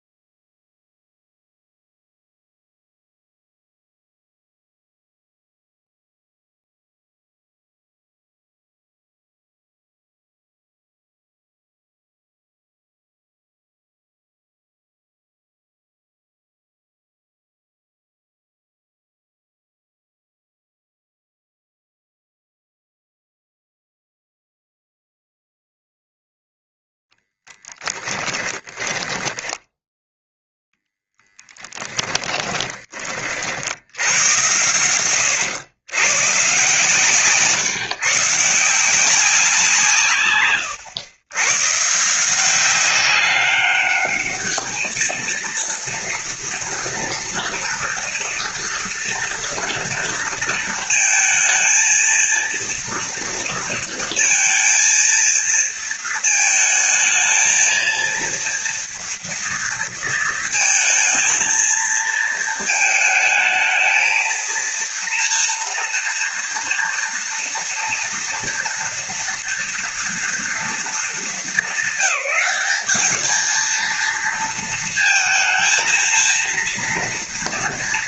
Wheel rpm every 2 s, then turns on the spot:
0, 0, 0, 0, 0, 0, 0, 0, 0, 0, 0, 0, 0, 0, 10, 0, 30, 110, 140, 160, 120, 190, 220, 230, 230, 220, 230, 230, 230, 230, 230, 220, 230, 230, 240, 230, 210, 230, 230.
28-30 32-34